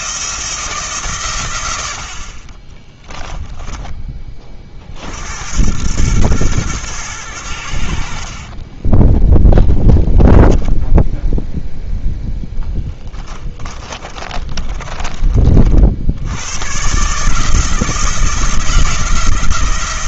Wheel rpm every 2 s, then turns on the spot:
160, 20, 40, 120, 30, 10, 10, 30, 130, 160.
2-4 8-16